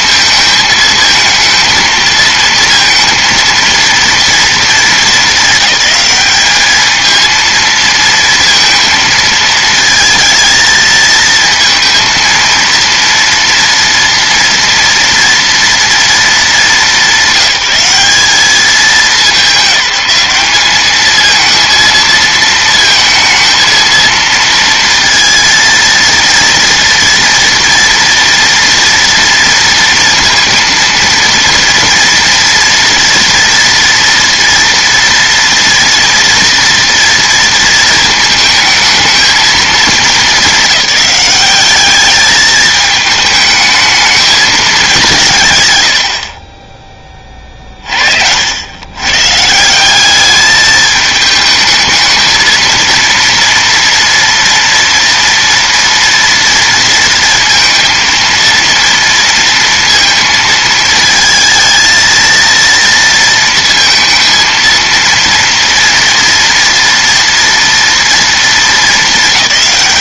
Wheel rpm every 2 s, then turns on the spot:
220, 230, 220, 220, 230, 220, 230, 230, 190, 200, 220, 220, 230, 230, 230, 230, 230, 230, 230, 220, 210, 210, 200, 30, 120, 210, 230, 230, 230, 230, 220, 230, 230, 230, 220.
46-48